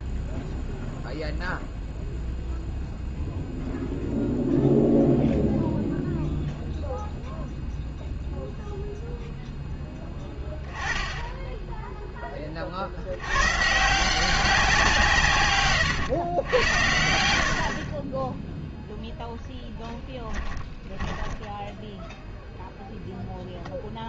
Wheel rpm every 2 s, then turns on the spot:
0, 0, 0, 0, 0, 10, 70, 170, 90, 0, 20, 0.
20-22